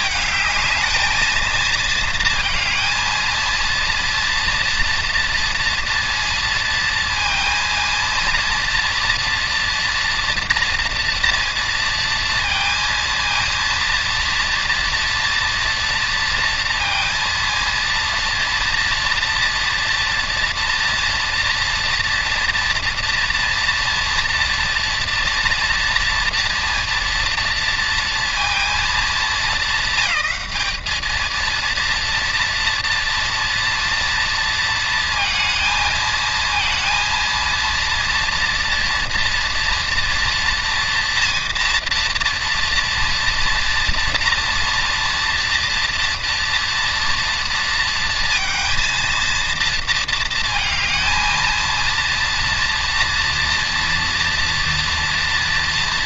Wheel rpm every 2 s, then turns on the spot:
220, 230, 230, 230, 230, 230, 230, 230, 230, 230, 240, 240, 230, 230, 230, 210, 230, 230, 230, 240, 240, 240, 240, 230, 230, 230, 240, 230.
none